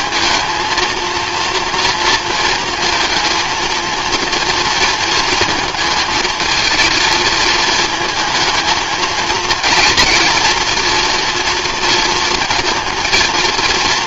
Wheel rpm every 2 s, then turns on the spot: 230, 230, 230, 220, 220, 230, 220.
none